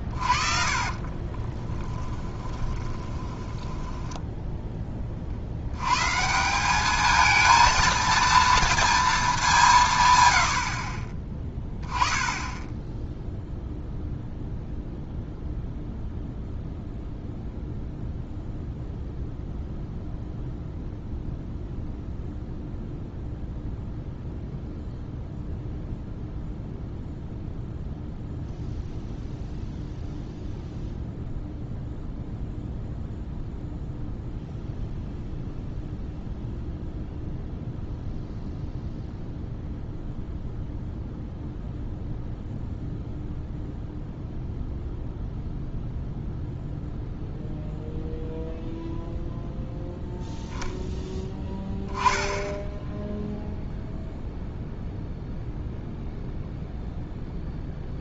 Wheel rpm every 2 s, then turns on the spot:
40, 10, 10, 200, 230, 60, 10, 0, 0, 0, 0, 0, 0, 0, 0, 0, 0, 0, 0, 0, 0, 0, 0, 0, 0, 0, 0, 0, 0.
0-4 10-12